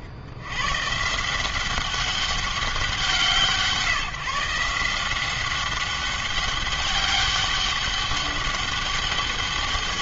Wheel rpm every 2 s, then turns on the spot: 90, 190, 160, 200, 200.
none